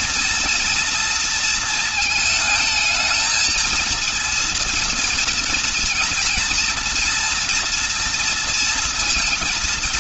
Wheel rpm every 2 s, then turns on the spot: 230, 220, 230, 240, 230.
none